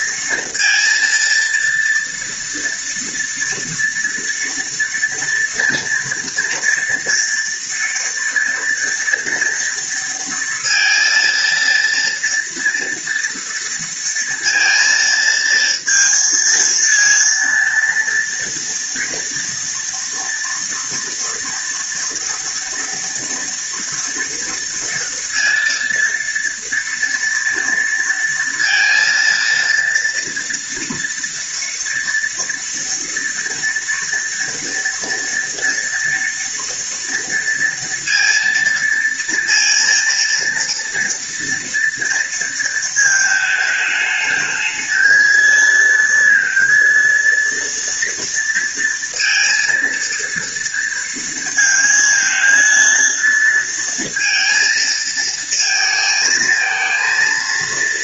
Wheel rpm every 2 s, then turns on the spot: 230, 230, 230, 230, 230, 230, 230, 230, 230, 230, 230, 240, 230, 230, 230, 230, 230, 230, 230, 230, 230, 220, 220, 230, 230, 230, 230, 230, 230.
none